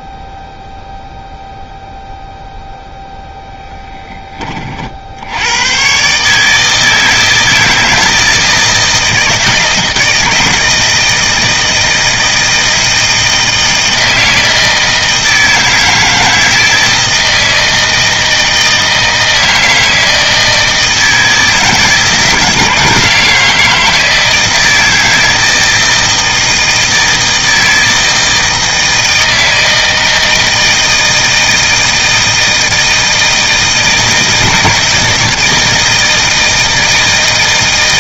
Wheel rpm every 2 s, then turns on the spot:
0, 0, 60, 160, 160, 160, 160, 160, 160, 160, 160, 160, 160, 160, 160, 160, 160, 160, 160.
none